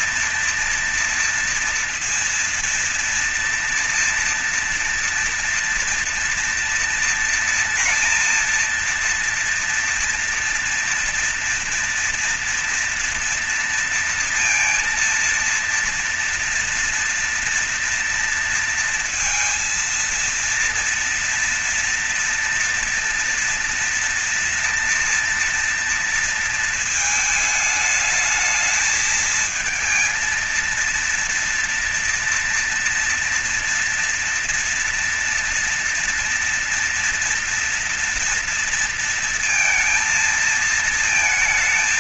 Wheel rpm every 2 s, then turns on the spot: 230, 230, 230, 240, 230, 230, 230, 230, 230, 230, 230, 230, 230, 230, 220, 230, 230, 230, 230, 230, 230.
none